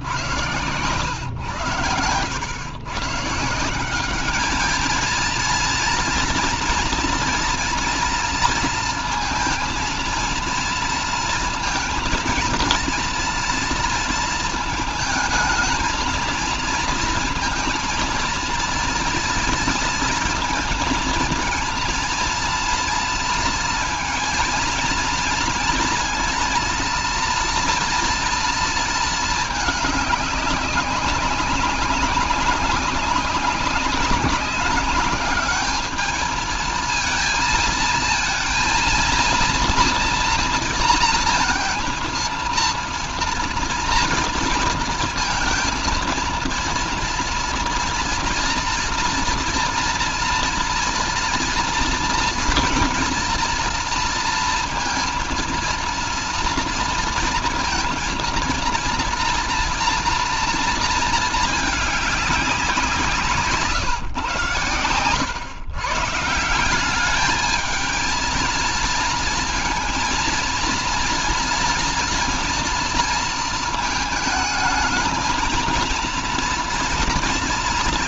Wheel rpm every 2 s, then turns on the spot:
120, 120, 210, 230, 230, 230, 230, 220, 230, 230, 230, 230, 230, 230, 230, 200, 200, 200, 220, 230, 230, 230, 230, 230, 230, 230, 240, 230, 230, 230, 220, 180, 120, 170, 230, 230, 230, 220, 230.
none